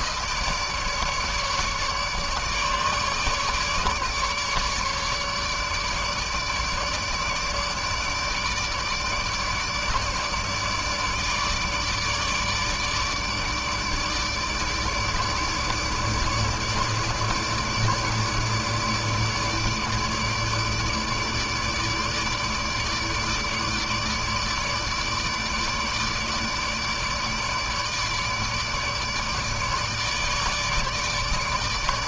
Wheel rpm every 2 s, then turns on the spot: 150, 150, 150, 150, 150, 150, 150, 150, 150, 150, 150, 150, 150, 150, 150, 150.
none